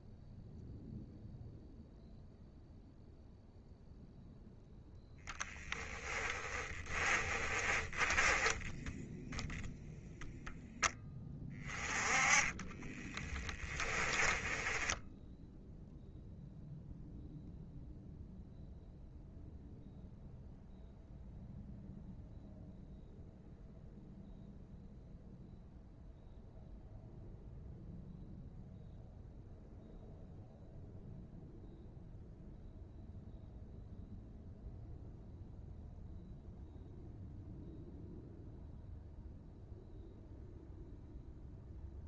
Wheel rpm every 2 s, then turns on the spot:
0, 0, 0, 20, 10, 10, 30, 10, 0, 0, 0, 0, 0, 0, 0, 0, 0, 0, 0, 0, 0.
6-10 12-16